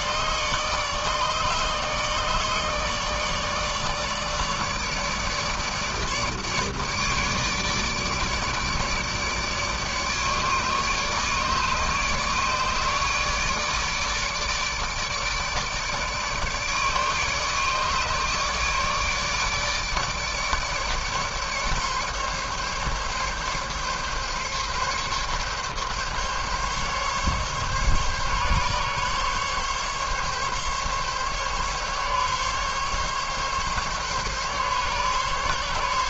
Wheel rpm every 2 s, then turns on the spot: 150, 150, 150, 150, 160, 150, 150, 150, 150, 150, 150, 140, 140, 140, 140, 140, 140, 140.
none